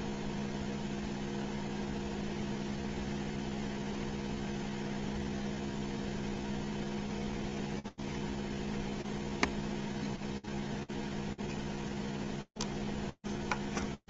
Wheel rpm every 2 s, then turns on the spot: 0, 0, 0, 0, 0, 0, 0.
none